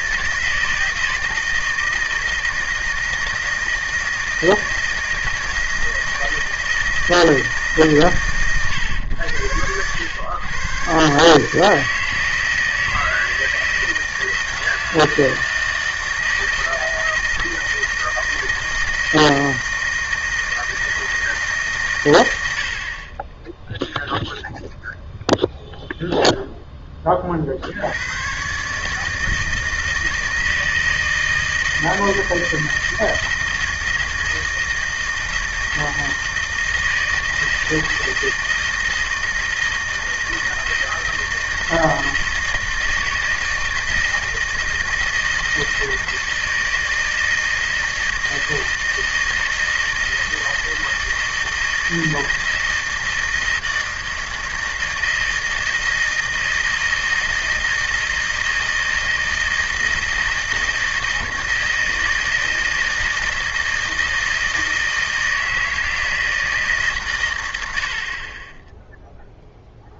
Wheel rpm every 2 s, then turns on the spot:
160, 160, 160, 160, 100, 130, 160, 160, 160, 160, 160, 40, 0, 10, 150, 160, 160, 160, 160, 160, 160, 160, 160, 160, 160, 160, 160, 160, 160, 160, 160, 160, 160, 140, 0.
none